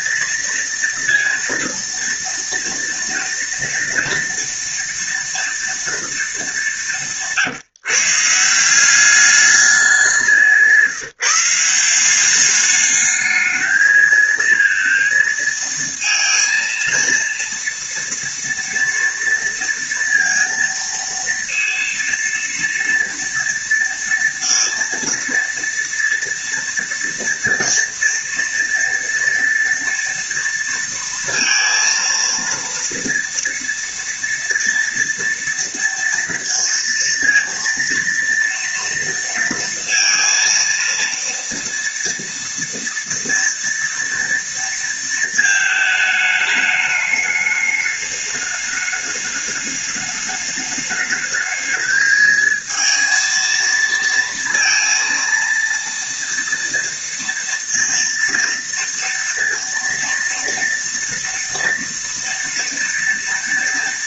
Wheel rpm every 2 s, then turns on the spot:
230, 230, 230, 200, 170, 180, 200, 230, 230, 240, 230, 230, 230, 230, 230, 230, 230, 230, 230, 230, 230, 230, 230, 210, 210, 210, 220, 230, 230, 230, 230, 230.
none